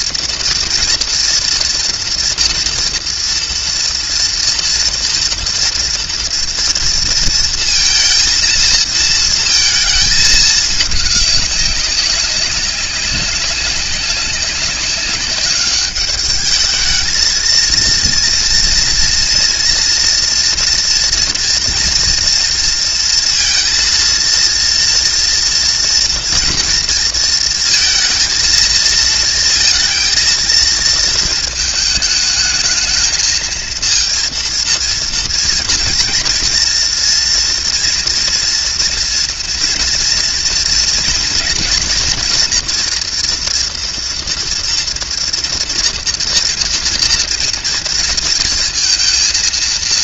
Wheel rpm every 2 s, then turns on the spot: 230, 230, 230, 230, 230, 220, 200, 200, 220, 230, 230, 230, 230, 230, 230, 230, 220, 230, 230, 230, 230, 240, 230, 240, 230.
none